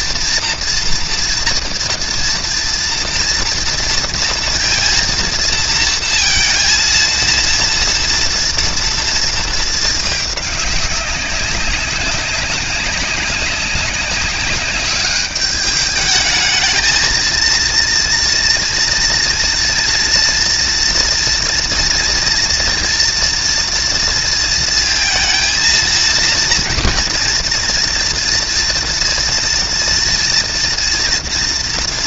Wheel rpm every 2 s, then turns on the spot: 230, 230, 230, 230, 230, 200, 200, 200, 220, 230, 230, 230, 230, 240, 230, 230.
none